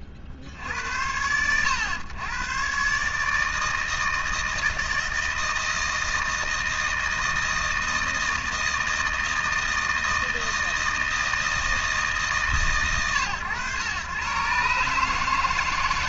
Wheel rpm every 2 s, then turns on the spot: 50, 130, 160, 160, 160, 160, 130, 130.
none